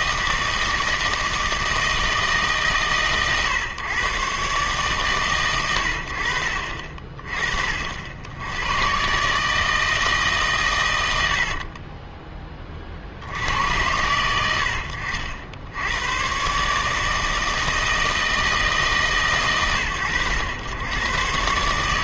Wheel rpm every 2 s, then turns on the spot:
160, 140, 130, 60, 110, 120, 30, 90, 140, 160, 110.
none